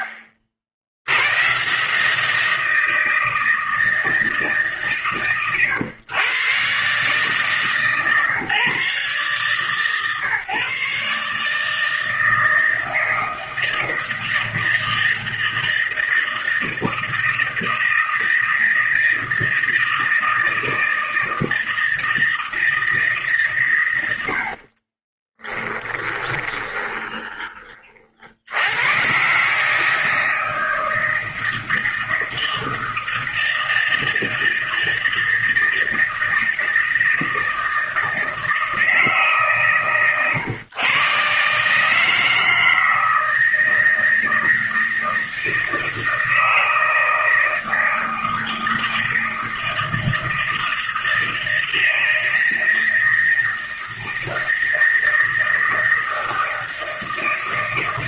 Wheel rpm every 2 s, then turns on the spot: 70, 160, 140, 140, 140, 150, 160, 160, 160, 160, 160, 150, 20, 20, 120, 160, 160, 160, 160, 150, 130, 160, 160, 160, 160, 160, 160, 160, 160.
24-28